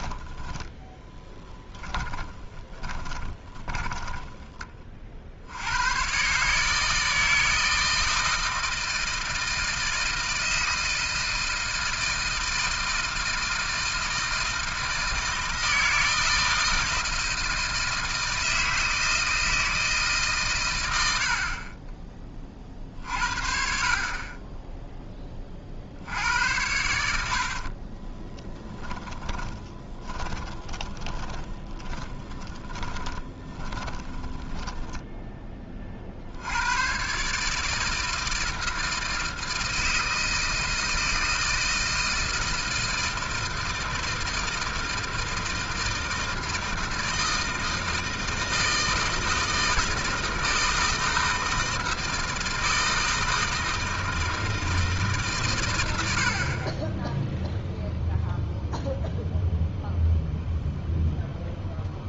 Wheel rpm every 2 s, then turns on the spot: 10, 10, 20, 150, 160, 160, 160, 160, 160, 160, 130, 40, 20, 90, 10, 20, 20, 20, 90, 160, 160, 160, 160, 160, 160, 160, 160, 160, 40, 0, 0.
2-4 28-36